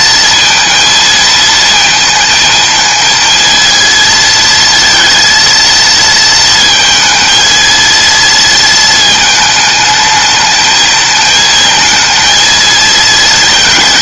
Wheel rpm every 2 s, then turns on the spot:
220, 220, 230, 220, 220, 220, 230.
none